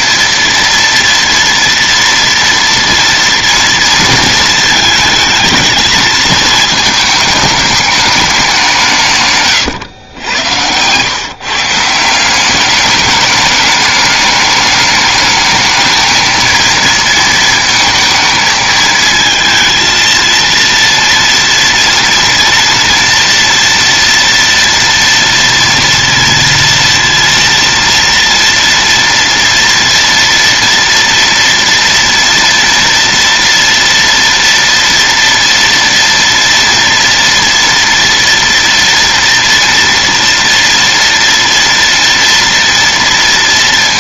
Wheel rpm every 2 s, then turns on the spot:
230, 230, 220, 220, 200, 110, 180, 210, 220, 220, 230, 230, 240, 230, 230, 230, 230, 230, 230, 230, 230, 230.
10-12